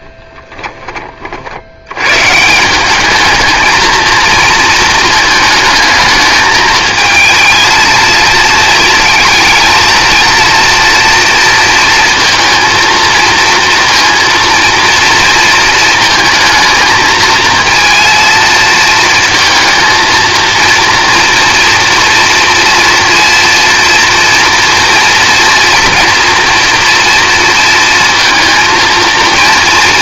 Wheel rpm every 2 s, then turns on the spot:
20, 190, 230, 220, 220, 230, 230, 230, 220, 230, 230, 230, 240, 230, 230.
none